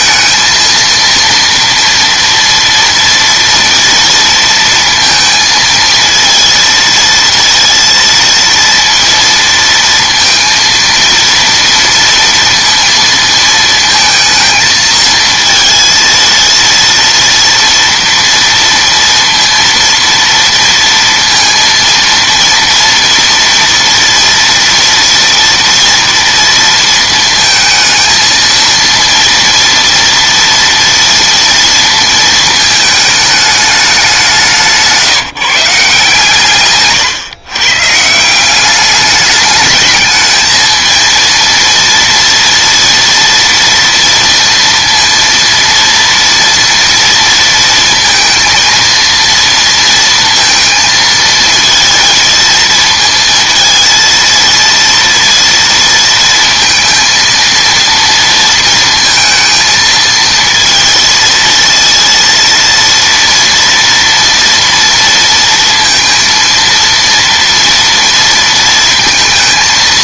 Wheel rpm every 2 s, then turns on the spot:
230, 230, 230, 230, 230, 230, 230, 220, 230, 230, 230, 230, 230, 230, 230, 240, 220, 160, 140, 200, 220, 230, 230, 230, 230, 230, 230, 230, 230, 230, 230, 230, 230, 230, 230.
34-36